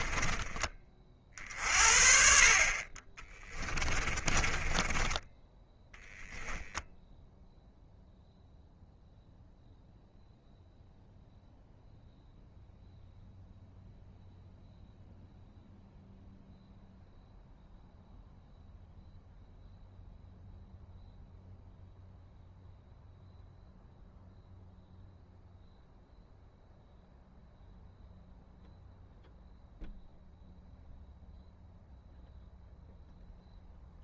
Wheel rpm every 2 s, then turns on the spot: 30, 30, 10, 10, 0, 0, 0, 0, 0, 0, 0, 0, 0, 0, 0, 0, 0.
4-6